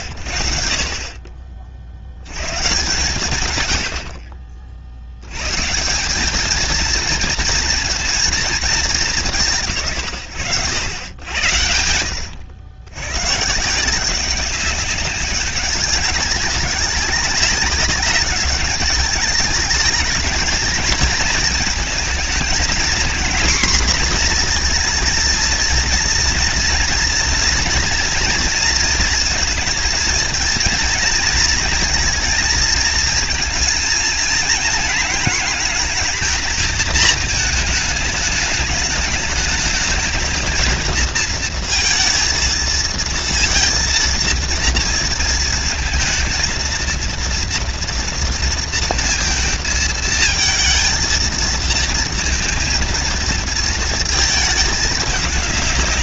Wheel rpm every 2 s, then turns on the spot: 60, 40, 200, 230, 120, 80, 180, 200, 200, 220, 220, 240, 230, 240, 220, 230, 220, 220, 210, 220, 230, 230, 220, 240, 230, 230, 230, 190.
none